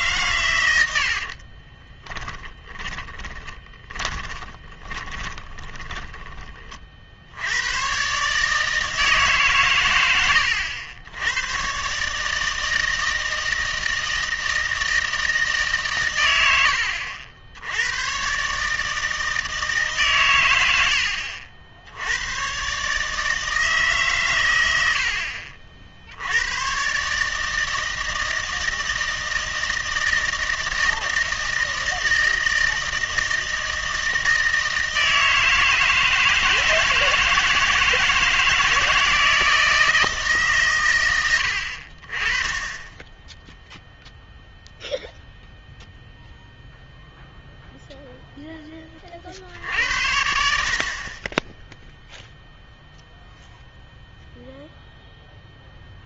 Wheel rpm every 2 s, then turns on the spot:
100, 10, 30, 30, 160, 100, 160, 160, 90, 150, 90, 130, 80, 120, 160, 160, 160, 160, 160, 160, 120, 20, 0, 0, 20, 50, 0, 0.
2-6